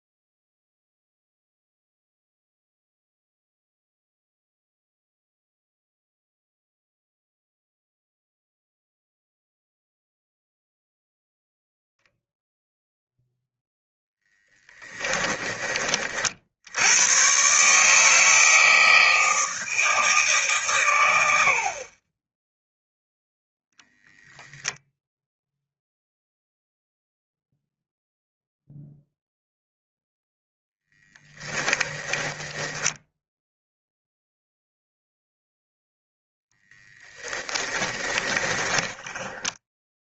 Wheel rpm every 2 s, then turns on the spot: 0, 0, 0, 0, 0, 0, 0, 30, 100, 160, 120, 0, 0, 0, 0, 0, 10, 0, 10, 10.
14-16 32-34 36-40